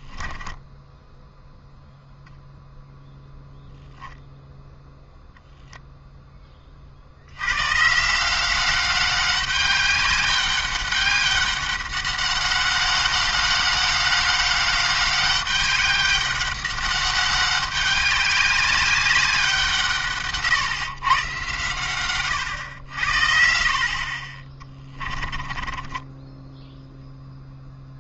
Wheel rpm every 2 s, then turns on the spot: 0, 0, 0, 30, 190, 200, 200, 200, 200, 200, 130, 90, 20, 0.
24-26